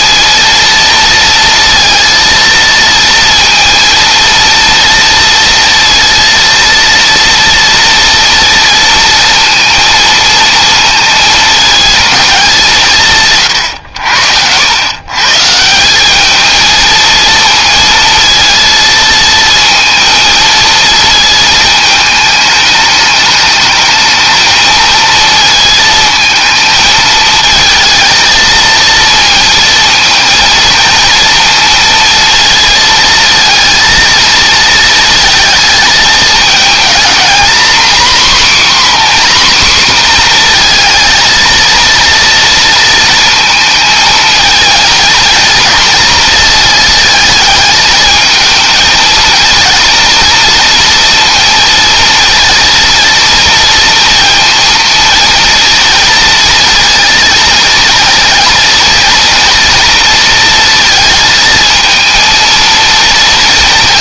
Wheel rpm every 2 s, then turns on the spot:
230, 230, 230, 230, 230, 220, 160, 120, 230, 230, 230, 210, 230, 220, 230, 230, 230, 230, 230, 270, 230, 230, 230, 220, 220, 230, 230, 230, 230, 240, 230, 230.
none